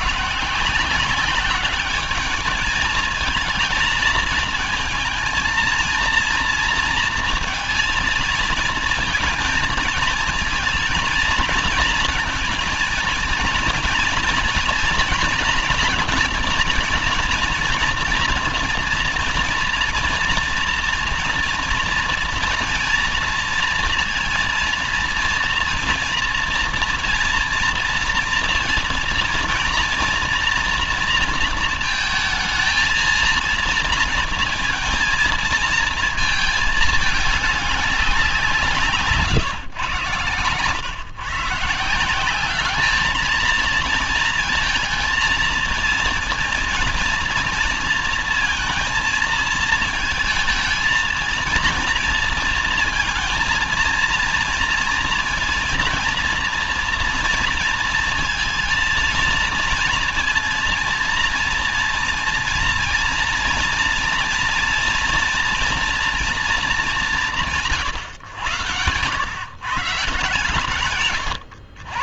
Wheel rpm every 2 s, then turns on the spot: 170, 210, 220, 230, 220, 230, 230, 230, 230, 230, 230, 230, 230, 230, 230, 230, 230, 230, 220, 170, 130, 200, 230, 230, 230, 220, 230, 230, 230, 230, 230, 230, 230, 220, 120, 140.
none